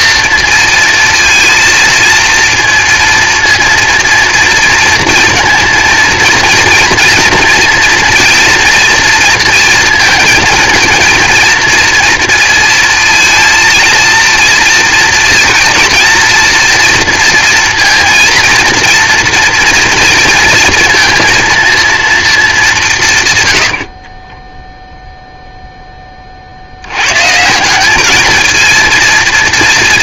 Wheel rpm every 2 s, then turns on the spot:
230, 230, 230, 230, 230, 230, 230, 230, 230, 230, 230, 210, 10, 80, 230.
24-26